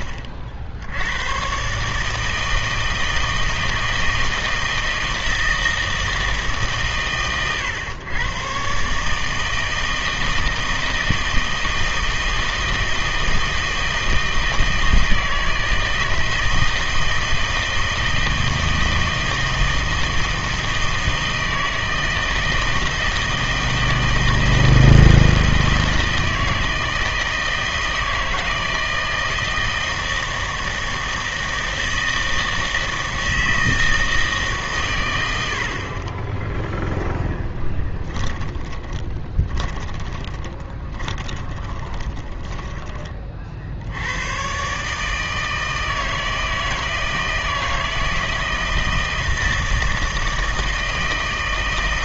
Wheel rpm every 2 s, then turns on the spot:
60, 160, 160, 140, 130, 160, 160, 160, 160, 160, 160, 160, 160, 160, 160, 160, 160, 150, 10, 20, 20, 20, 130, 160, 160, 160.
38-44